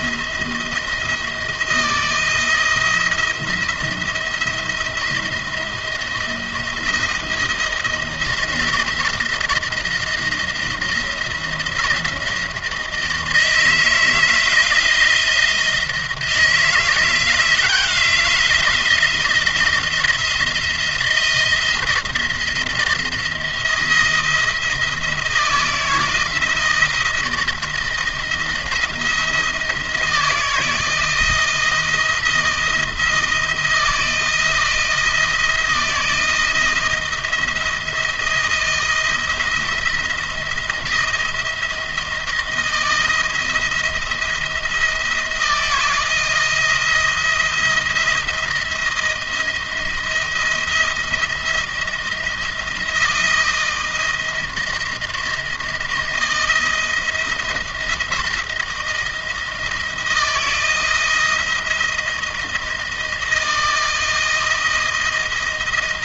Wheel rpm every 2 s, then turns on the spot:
170, 170, 170, 170, 170, 170, 160, 160, 170, 170, 170, 170, 160, 170, 170, 160, 160, 160, 170, 170, 170, 170, 170, 160, 170, 170, 160, 170, 170, 170, 170, 170, 170.
none